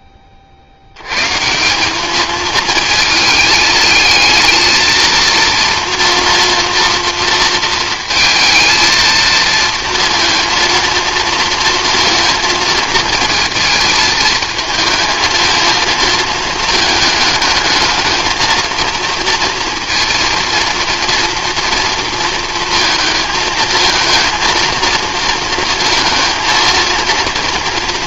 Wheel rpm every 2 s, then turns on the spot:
60, 220, 220, 230, 230, 230, 230, 220, 220, 230, 230, 230, 230, 230.
none